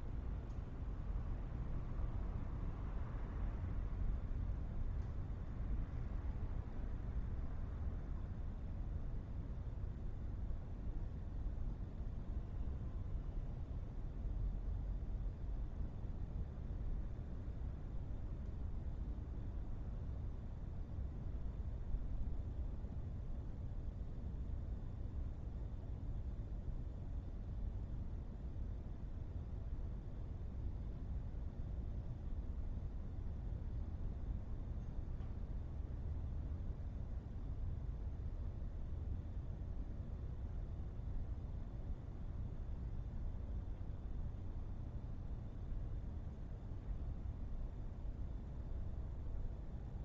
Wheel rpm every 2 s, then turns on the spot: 0, 0, 0, 0, 0, 0, 0, 0, 0, 0, 0, 0, 0, 0, 0, 0, 0, 0, 0, 0, 0, 0, 0, 0, 0.
none